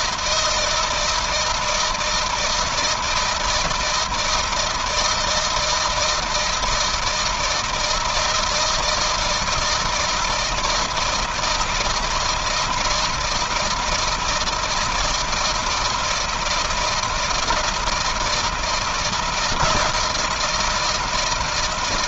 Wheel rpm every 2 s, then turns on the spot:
160, 160, 160, 160, 160, 160, 160, 170, 170, 160, 160.
none